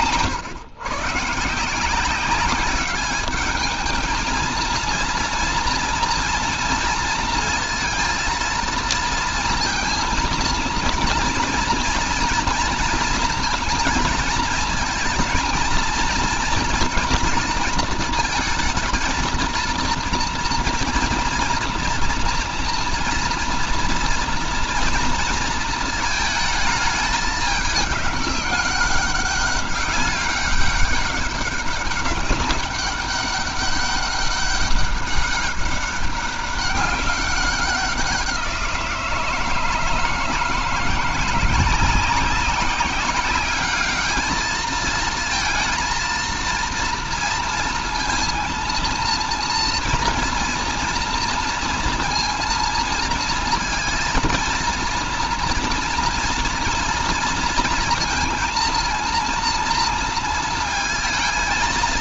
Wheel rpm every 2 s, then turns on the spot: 130, 200, 230, 230, 230, 230, 230, 220, 220, 220, 230, 230, 230, 220, 200, 200, 200, 200, 200, 170, 160, 190, 220, 230, 230, 240, 230, 230, 230, 230, 230.
none